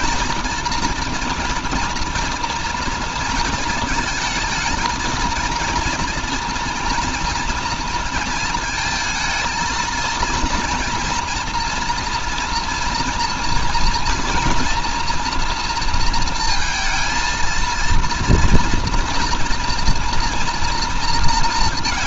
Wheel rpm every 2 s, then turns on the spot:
230, 230, 220, 230, 220, 230, 230, 240, 230, 230, 230.
none